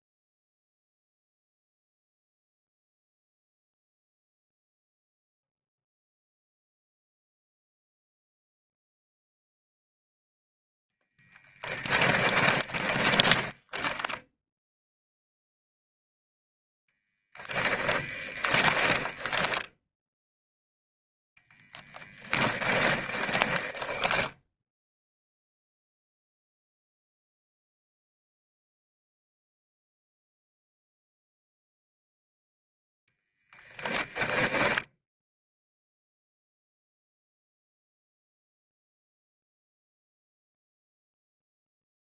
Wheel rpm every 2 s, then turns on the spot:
0, 0, 0, 0, 0, 0, 20, 0, 0, 20, 0, 20, 0, 0, 0, 0, 0, 10, 0, 0, 0.
12-14 18-20 22-24